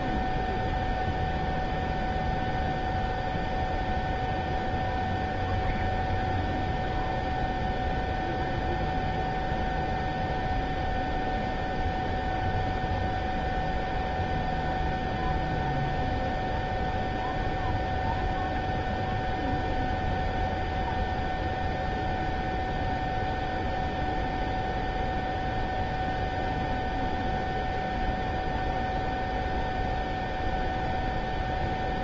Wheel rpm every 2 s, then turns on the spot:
0, 0, 0, 0, 0, 0, 0, 0, 0, 0, 0, 0, 0, 0, 0, 0.
none